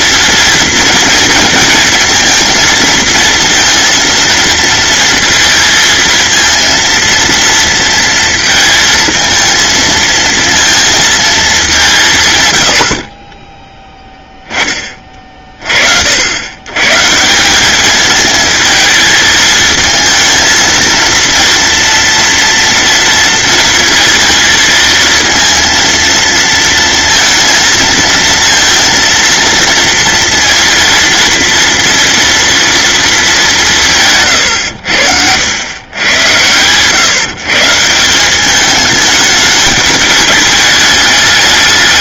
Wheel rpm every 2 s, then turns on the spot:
230, 230, 230, 230, 220, 230, 80, 20, 130, 220, 230, 230, 230, 230, 230, 230, 230, 100, 120, 210, 210.
none